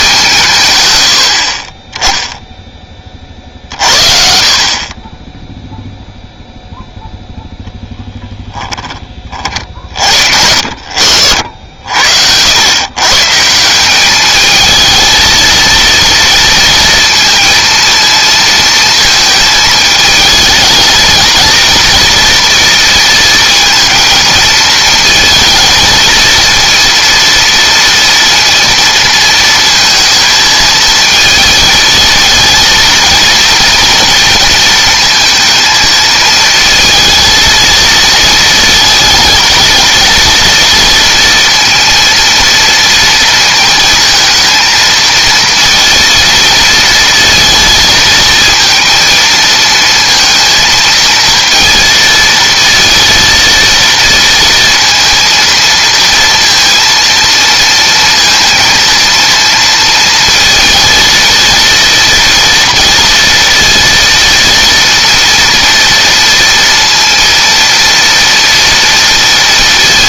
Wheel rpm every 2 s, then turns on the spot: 110, 10, 30, 0, 10, 60, 120, 220, 230, 220, 220, 230, 230, 230, 230, 220, 230, 230, 220, 230, 230, 230, 230, 230, 230, 230, 230, 230, 230, 230, 230, 230, 230, 230, 230.
none